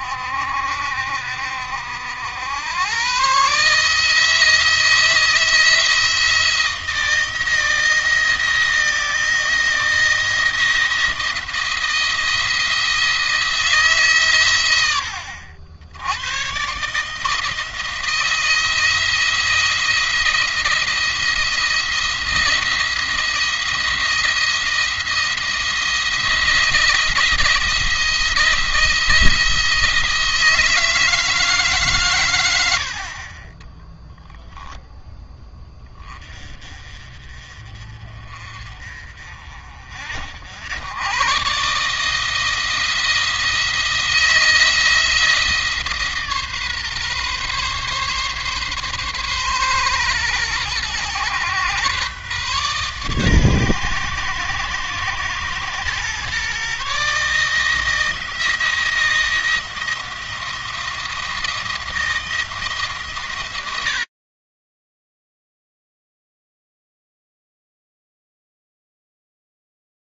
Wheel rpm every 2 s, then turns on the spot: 60, 110, 160, 160, 170, 170, 170, 100, 140, 170, 170, 170, 170, 170, 170, 160, 60, 10, 40, 40, 100, 170, 170, 140, 130, 110, 130, 120, 140, 170, 170, 140, 10, 0, 0.
none